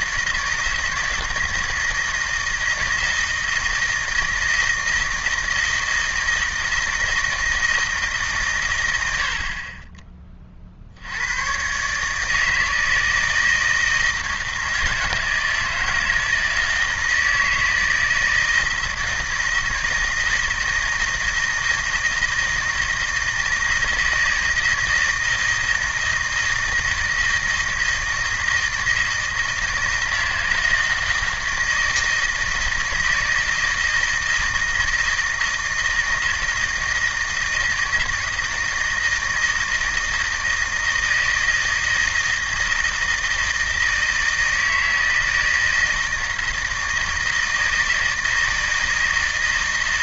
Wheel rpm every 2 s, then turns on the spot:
160, 160, 160, 160, 100, 70, 160, 160, 160, 160, 160, 160, 160, 160, 160, 160, 160, 160, 160, 160, 160, 160, 160, 160, 160.
none